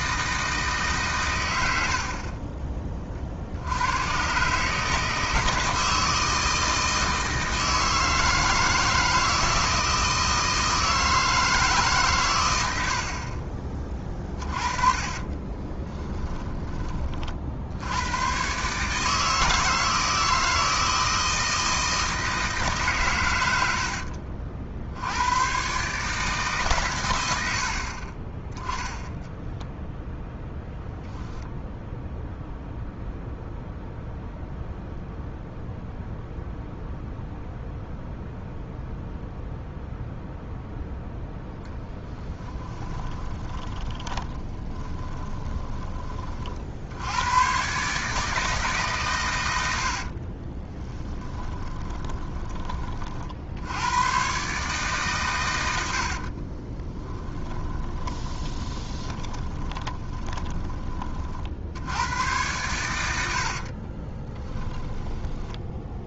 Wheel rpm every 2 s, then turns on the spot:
150, 30, 150, 160, 160, 160, 80, 30, 20, 140, 160, 140, 70, 130, 10, 0, 0, 0, 0, 0, 0, 20, 20, 70, 150, 10, 30, 130, 20, 20, 20, 100, 10.
14-16 42-46 50-52 56-60 64-66